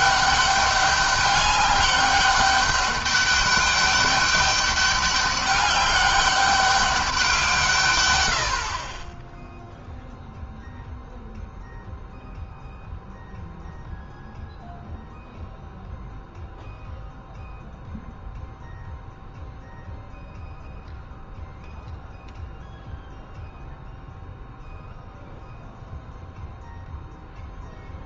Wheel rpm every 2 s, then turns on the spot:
200, 200, 200, 200, 40, 0, 0, 0, 0, 0, 0, 0, 0, 0.
none